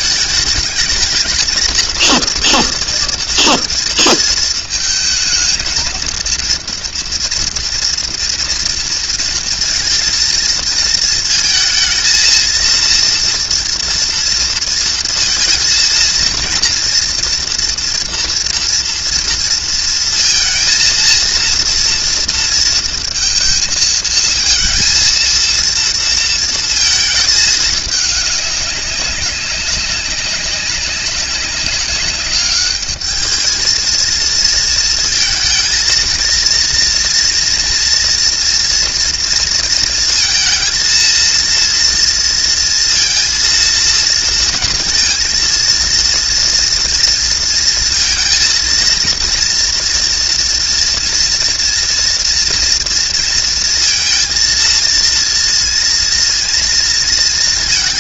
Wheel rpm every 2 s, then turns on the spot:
210, 230, 220, 230, 230, 230, 230, 230, 230, 230, 230, 230, 230, 230, 200, 200, 200, 230, 230, 230, 230, 230, 230, 230, 230, 240, 230, 230, 230.
none